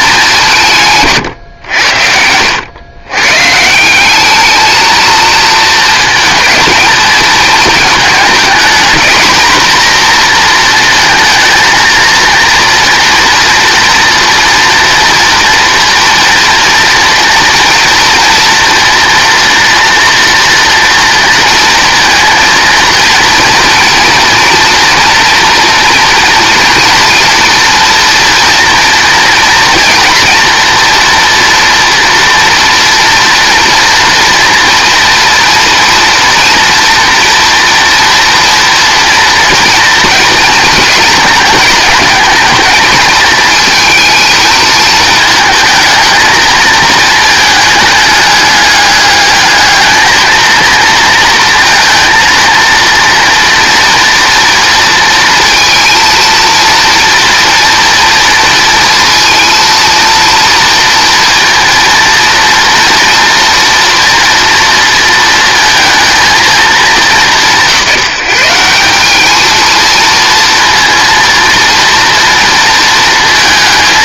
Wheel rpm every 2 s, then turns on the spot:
170, 100, 220, 230, 230, 230, 230, 230, 230, 240, 230, 230, 230, 230, 230, 240, 230, 240, 240, 230, 230, 220, 220, 220, 210, 220, 230, 230, 230, 230, 230, 230, 230, 220, 180, 230, 230.
none